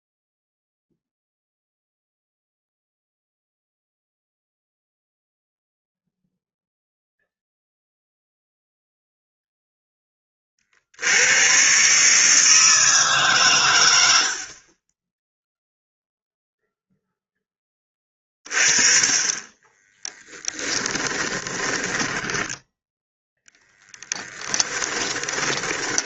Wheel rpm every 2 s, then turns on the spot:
0, 0, 0, 0, 0, 50, 160, 50, 0, 30, 10, 10, 10.
20-26